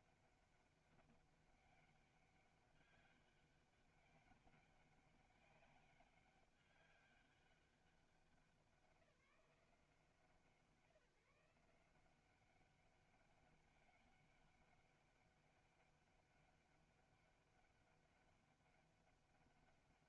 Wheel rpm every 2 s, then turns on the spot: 200, 200, 200, 200, 190, 170, 200, 200, 200, 200.
none